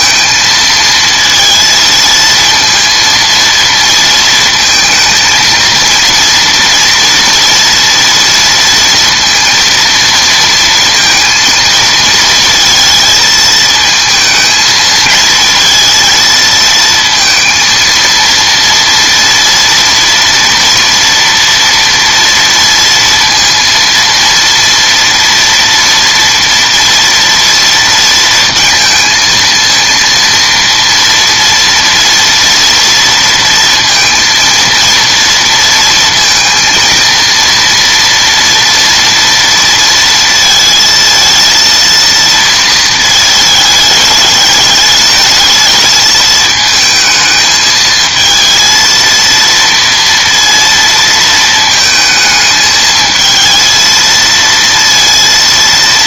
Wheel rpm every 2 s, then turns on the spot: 230, 230, 220, 230, 230, 230, 230, 220, 230, 230, 230, 230, 230, 230, 230, 230, 230, 230, 230, 230, 220, 230, 210, 220, 230, 230, 220, 230.
none